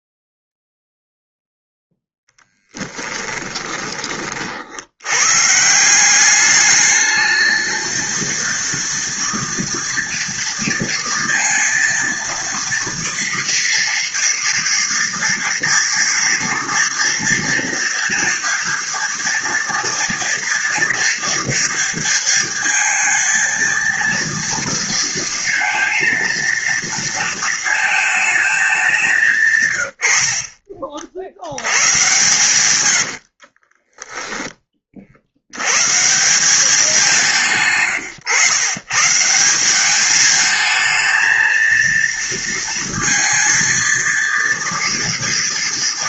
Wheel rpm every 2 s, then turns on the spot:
0, 10, 70, 210, 230, 230, 230, 230, 230, 230, 230, 230, 230, 230, 200, 50, 110, 20, 180, 130, 220, 230, 230.
2-4 30-34